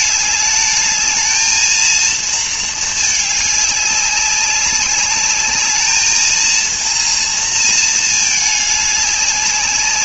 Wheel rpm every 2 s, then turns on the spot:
210, 220, 200, 230, 210.
none